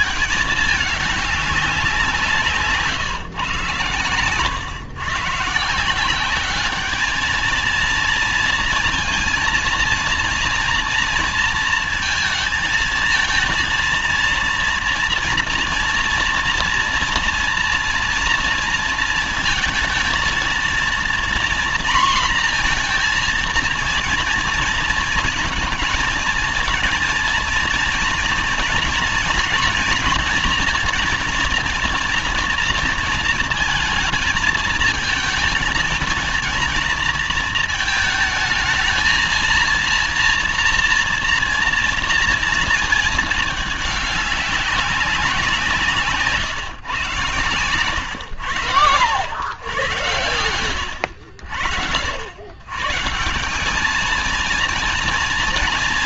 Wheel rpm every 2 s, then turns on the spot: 220, 150, 120, 200, 230, 230, 220, 230, 230, 230, 230, 240, 230, 230, 240, 230, 230, 220, 230, 220, 230, 230, 200, 130, 100, 110, 130, 230.
none